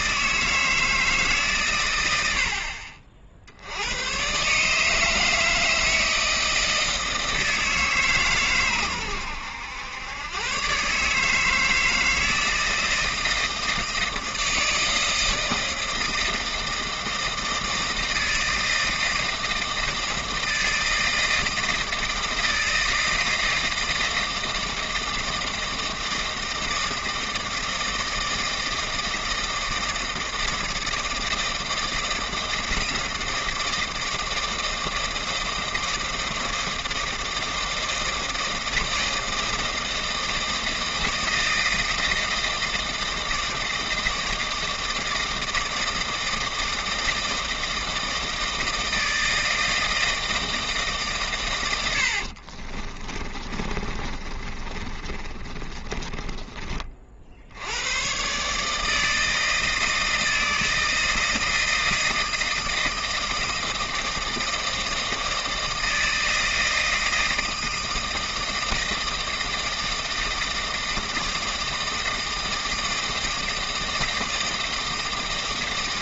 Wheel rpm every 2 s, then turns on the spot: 160, 50, 150, 160, 120, 130, 160, 160, 160, 160, 160, 160, 160, 160, 160, 160, 160, 160, 160, 160, 160, 160, 160, 160, 160, 160, 40, 30, 30, 150, 160, 160, 160, 160, 160, 160, 160, 160.
52-56